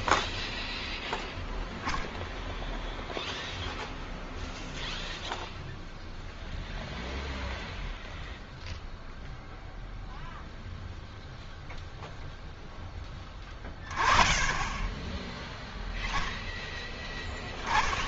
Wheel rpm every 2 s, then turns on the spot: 0, 0, 0, 0, 0, 0, 10, 10, 0.
none